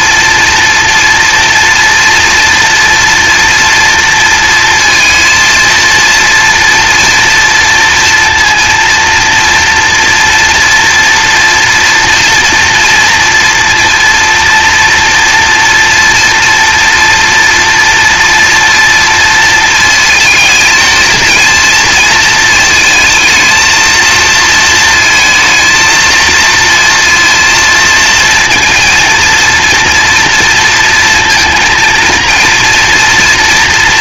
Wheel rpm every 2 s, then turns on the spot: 230, 230, 230, 230, 230, 230, 240, 230, 230, 230, 220, 220, 230, 230, 230, 230, 230.
none